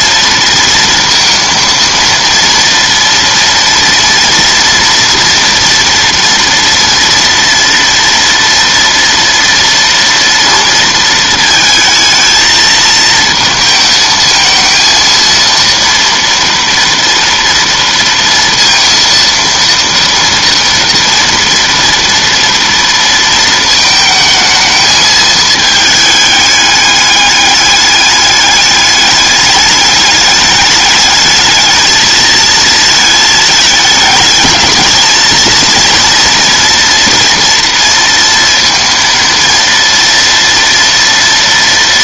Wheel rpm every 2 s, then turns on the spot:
230, 230, 230, 230, 230, 230, 220, 220, 230, 230, 230, 230, 220, 210, 210, 210, 220, 220, 230, 230, 230.
none